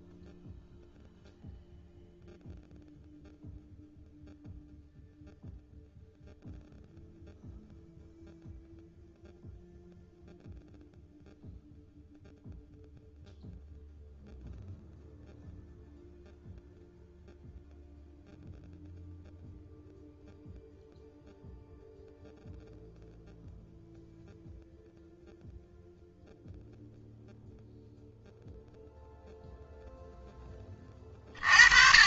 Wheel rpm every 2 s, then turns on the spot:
0, 0, 0, 0, 0, 0, 0, 0, 0, 0, 0, 0, 0, 0, 0, 20.
none